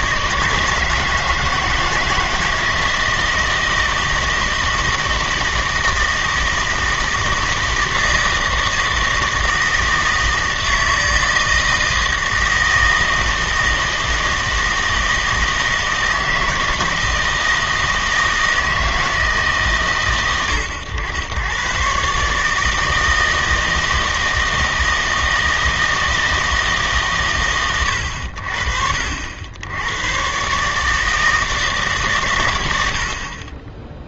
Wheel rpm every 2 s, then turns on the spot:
160, 160, 160, 160, 160, 160, 160, 160, 160, 160, 110, 150, 160, 160, 60, 130, 100.
none